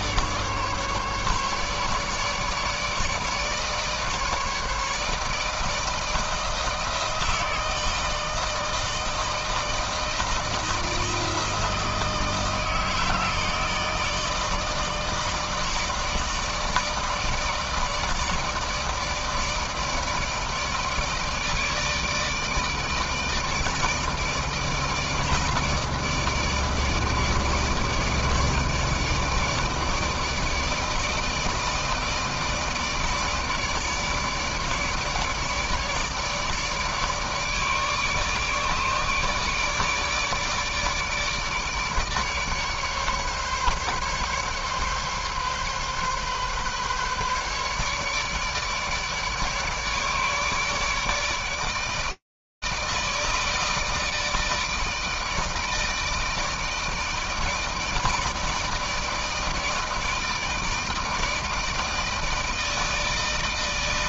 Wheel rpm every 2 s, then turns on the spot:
150, 150, 150, 160, 160, 160, 160, 160, 160, 160, 160, 160, 160, 160, 150, 160, 150, 150, 150, 150, 150, 150, 140, 140, 150, 150, 160, 160, 160, 160, 160, 160.
none